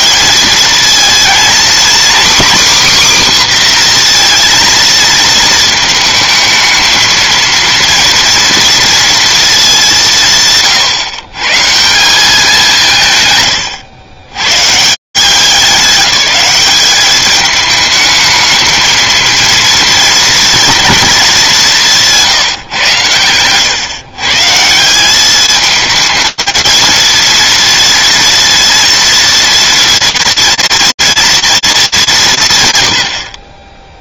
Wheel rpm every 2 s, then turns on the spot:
230, 270, 240, 220, 230, 160, 180, 130, 200, 220, 230, 150, 160, 230, 230, 230, 120.
none